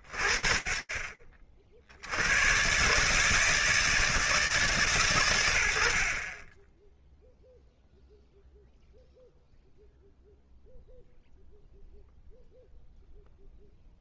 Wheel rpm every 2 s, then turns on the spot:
40, 70, 160, 60, 0, 0, 0.
none